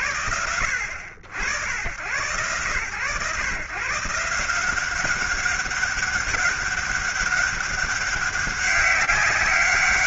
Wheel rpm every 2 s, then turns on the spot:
90, 120, 200, 200, 200.
none